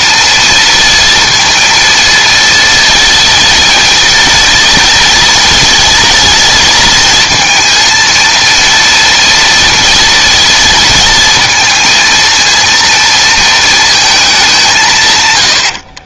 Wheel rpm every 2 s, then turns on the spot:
230, 230, 230, 230, 230, 230, 230, 160.
none